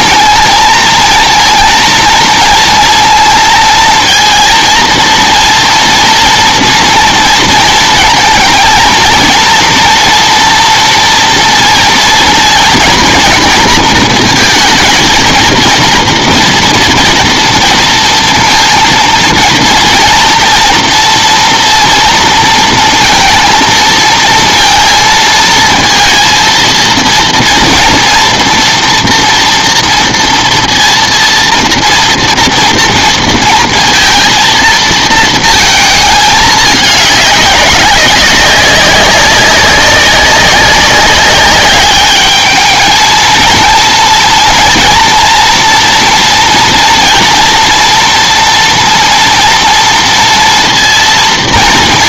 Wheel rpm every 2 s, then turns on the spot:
230, 230, 230, 230, 230, 230, 240, 230, 230, 230, 230, 230, 230, 230, 240, 230, 230, 230, 210, 200, 200, 220, 230, 230, 240, 230.
none